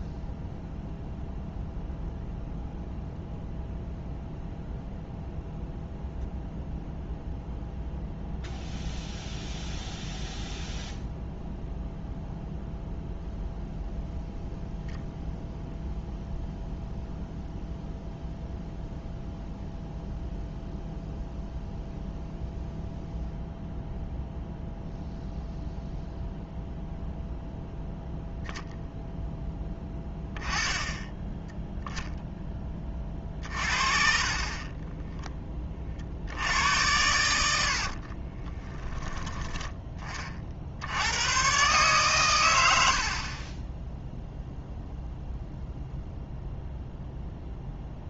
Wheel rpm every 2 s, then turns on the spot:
0, 0, 0, 0, 0, 0, 0, 0, 0, 0, 0, 0, 0, 0, 0, 10, 20, 20, 100, 10, 80, 80, 0, 0.
none